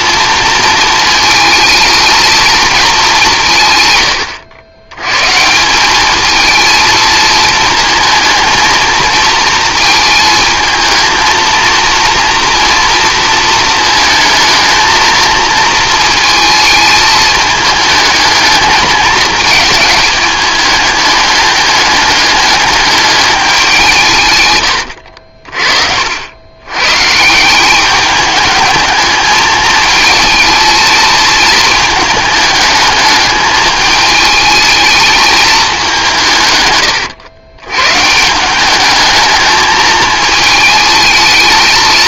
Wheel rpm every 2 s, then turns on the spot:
230, 220, 90, 220, 220, 220, 230, 220, 220, 220, 210, 210, 120, 110, 210, 220, 210, 220, 110, 180, 220.
none